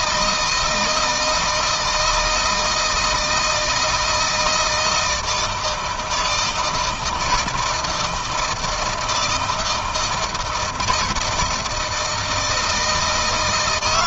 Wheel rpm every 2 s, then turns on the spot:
160, 160, 160, 160, 160, 160, 170.
none